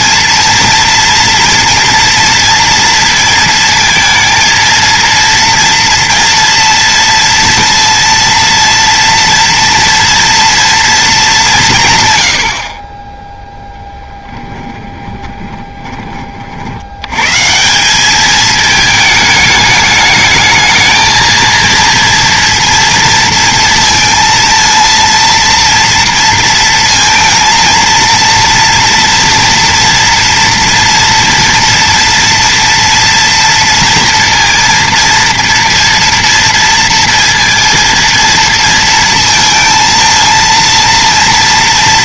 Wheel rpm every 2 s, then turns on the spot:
230, 230, 230, 240, 230, 230, 50, 20, 70, 220, 220, 230, 230, 230, 230, 230, 230, 230, 230, 230, 230.
12-16